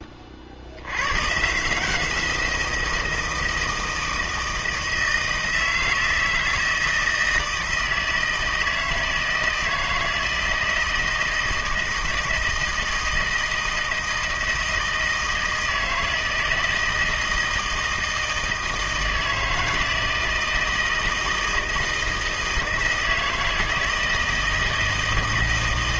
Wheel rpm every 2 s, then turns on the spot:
60, 170, 160, 160, 160, 160, 160, 160, 160, 160, 160, 160, 160.
none